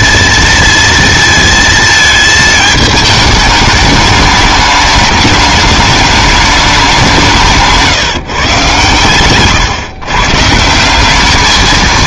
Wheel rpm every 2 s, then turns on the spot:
230, 220, 210, 200, 130, 150.
none